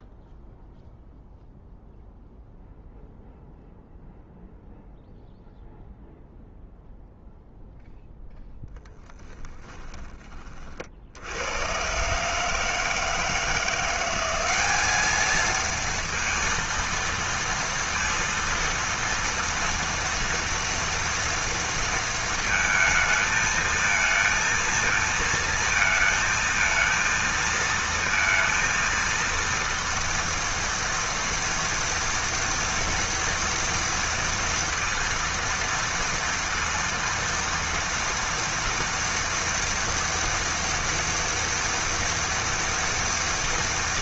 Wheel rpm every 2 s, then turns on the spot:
0, 0, 0, 0, 0, 30, 140, 190, 230, 230, 230, 230, 230, 230, 230, 230, 230, 230, 230, 230, 230, 230.
none